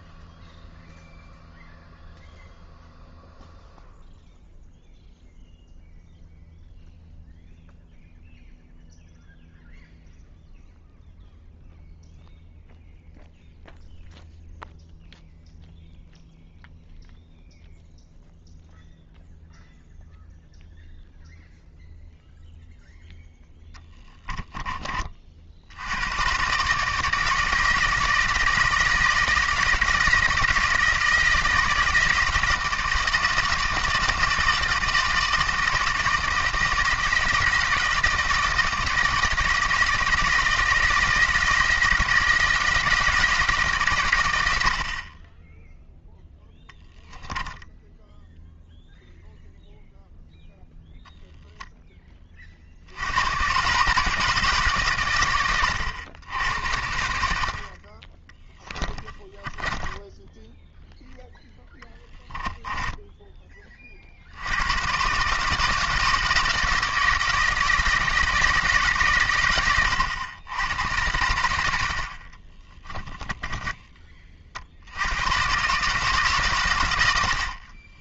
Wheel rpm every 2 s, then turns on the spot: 0, 0, 0, 0, 0, 0, 0, 0, 0, 0, 0, 0, 40, 140, 160, 160, 160, 160, 160, 160, 160, 170, 60, 0, 0, 0, 60, 140, 80, 10, 10, 10, 100, 160, 150, 90, 20, 60, 110.
58-60 72-74